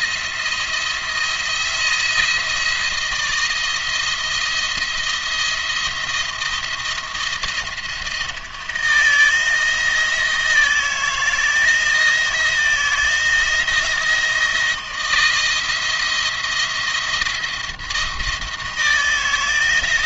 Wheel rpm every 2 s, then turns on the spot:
170, 170, 170, 170, 160, 160, 170, 160, 170, 160.
none